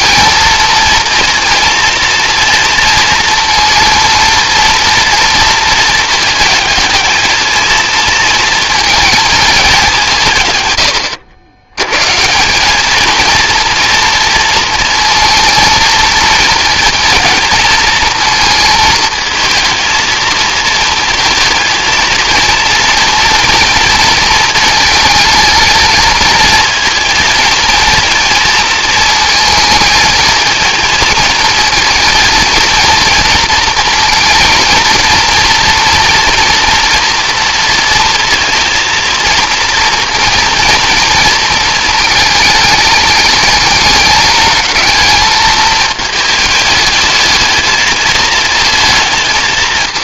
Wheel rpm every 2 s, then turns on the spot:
230, 230, 240, 220, 220, 100, 210, 230, 230, 220, 230, 230, 220, 230, 220, 220, 230, 230, 230, 230, 230, 210, 220, 210, 220.
none